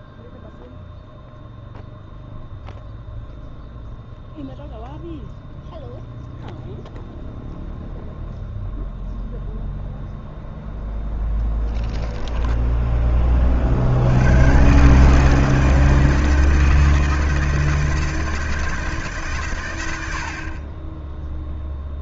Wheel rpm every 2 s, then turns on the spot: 0, 0, 0, 0, 0, 0, 10, 130, 160, 160, 30.
12-14